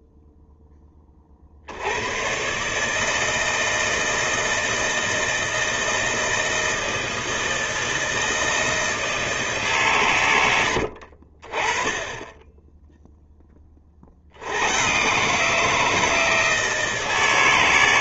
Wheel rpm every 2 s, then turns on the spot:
10, 130, 160, 160, 160, 90, 10, 100, 160.
10-12